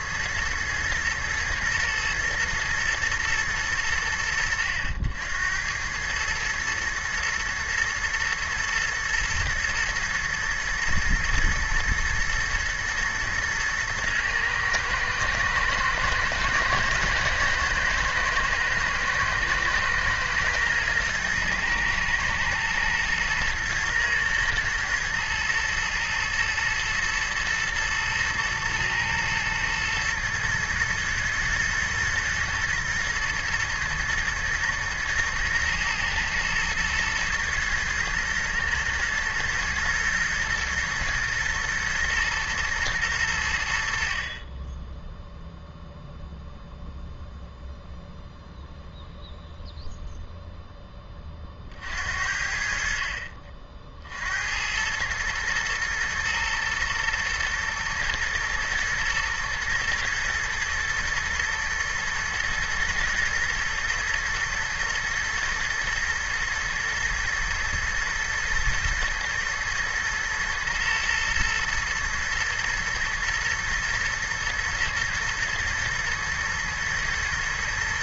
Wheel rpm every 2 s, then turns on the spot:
110, 120, 90, 110, 120, 110, 110, 110, 120, 110, 110, 110, 110, 120, 120, 120, 110, 110, 110, 110, 110, 120, 30, 0, 0, 0, 60, 80, 120, 110, 120, 120, 120, 110, 110, 110, 110, 110, 110.
none